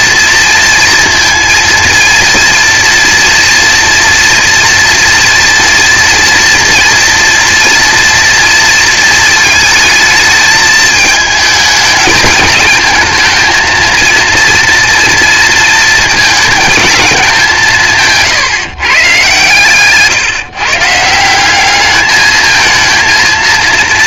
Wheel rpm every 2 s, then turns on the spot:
230, 230, 240, 240, 230, 220, 220, 230, 220, 150, 140, 220.
none